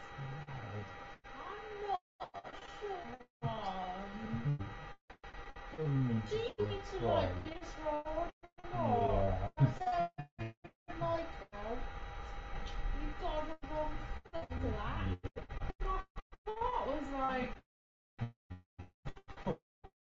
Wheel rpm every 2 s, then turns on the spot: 0, 0, 0, 0, 0, 0, 0, 0, 0, 0.
none